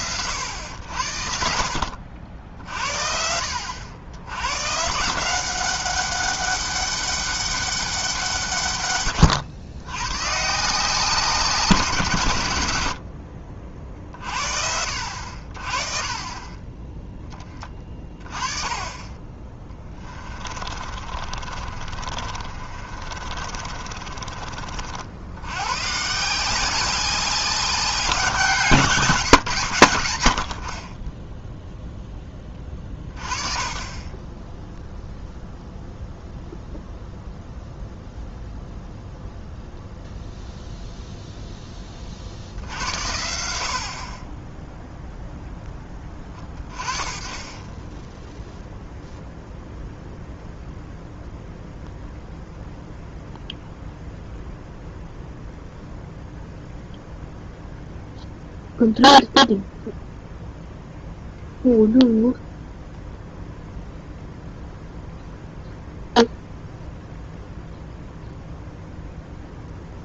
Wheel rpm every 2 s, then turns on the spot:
80, 60, 140, 200, 130, 170, 100, 60, 20, 20, 30, 40, 50, 190, 160, 30, 20, 0, 0, 0, 0, 80, 0, 20, 0, 0, 0, 0, 0, 0, 0, 0, 0, 0, 0.
20-24